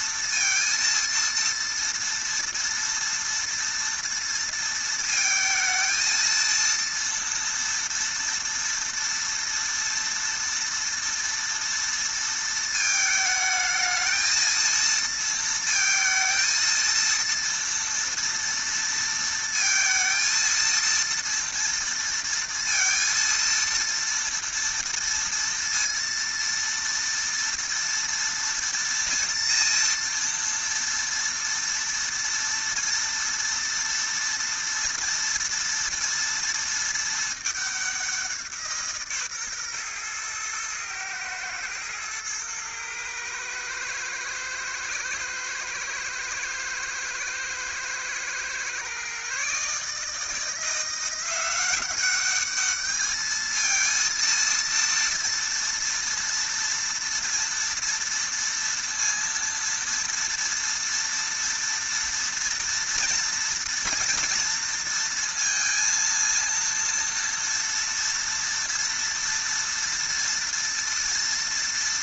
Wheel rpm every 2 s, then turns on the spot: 230, 230, 230, 230, 230, 230, 230, 230, 230, 230, 230, 230, 230, 230, 230, 230, 230, 230, 230, 170, 110, 110, 110, 110, 120, 170, 210, 230, 230, 230, 230, 230, 230, 230, 230, 230.
none